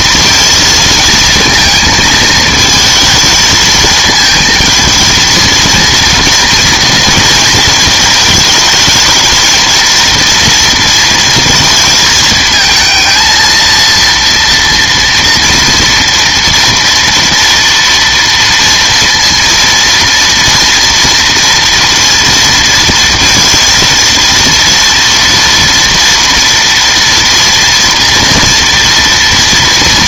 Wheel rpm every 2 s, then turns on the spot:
230, 220, 220, 230, 220, 230, 220, 230, 230, 230, 230, 230, 230, 230, 230.
none